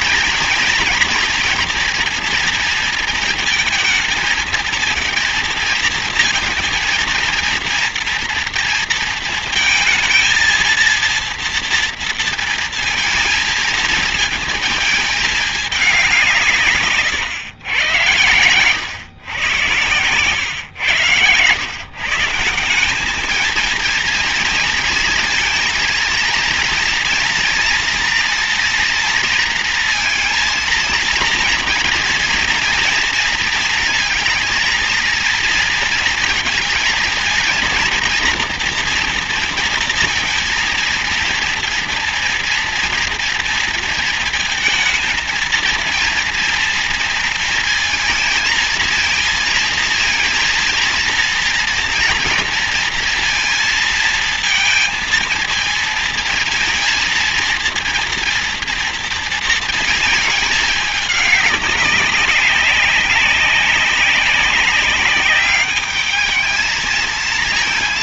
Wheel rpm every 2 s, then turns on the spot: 230, 230, 220, 220, 230, 230, 230, 220, 170, 110, 110, 160, 230, 230, 230, 230, 230, 230, 230, 240, 230, 230, 230, 230, 230, 230, 230, 230, 230, 230, 220, 200, 200, 220.
none